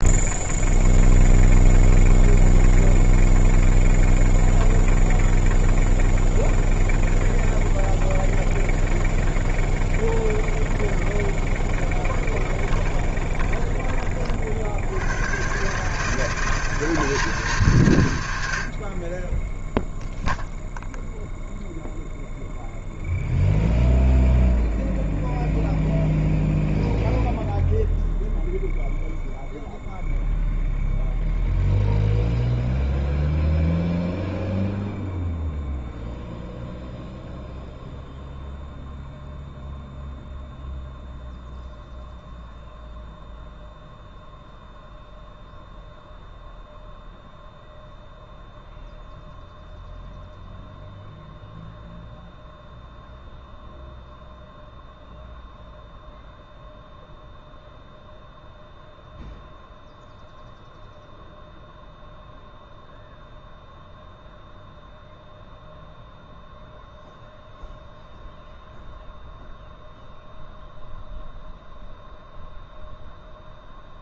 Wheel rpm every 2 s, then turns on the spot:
0, 0, 0, 0, 0, 0, 30, 120, 210, 20, 0, 0, 0, 0, 0, 0, 0, 0, 0, 0, 0, 0, 0, 0, 0, 0, 0, 0, 0, 0, 0, 0, 0, 0, 0, 0, 0.
12-14